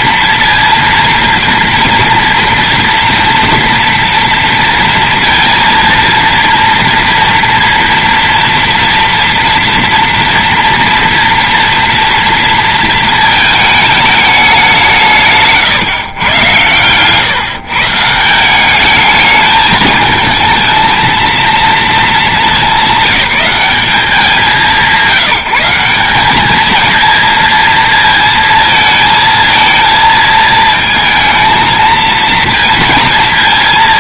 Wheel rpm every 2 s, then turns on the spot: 230, 230, 230, 230, 230, 230, 230, 190, 110, 190, 220, 200, 180, 220, 220, 220, 230.
none